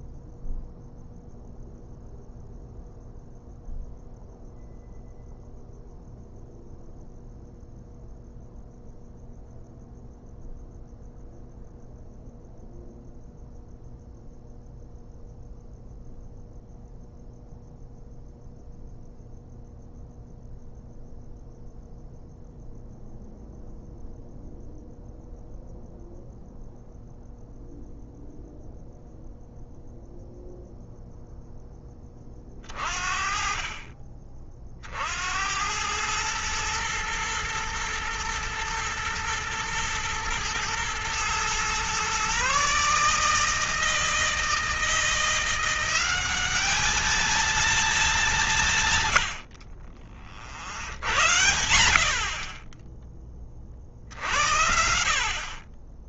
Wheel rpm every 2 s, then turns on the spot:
0, 0, 0, 0, 0, 0, 0, 0, 0, 0, 0, 0, 0, 0, 0, 0, 30, 50, 110, 120, 110, 140, 160, 210, 170, 50, 20, 60.
none